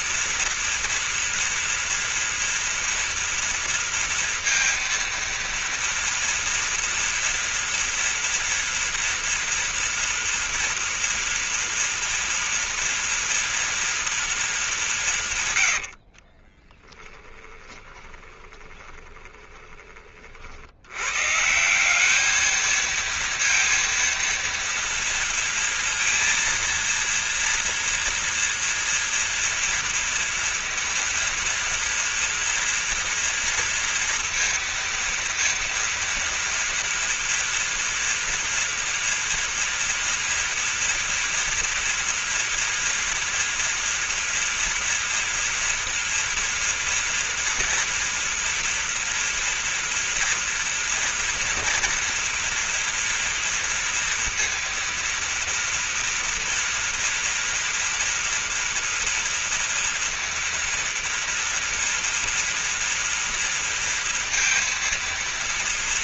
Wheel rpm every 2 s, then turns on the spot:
230, 240, 230, 230, 230, 230, 230, 210, 20, 20, 80, 220, 230, 230, 230, 230, 240, 230, 230, 230, 230, 240, 230, 230, 230, 240, 230, 230, 230, 230, 230, 230, 230.
16-20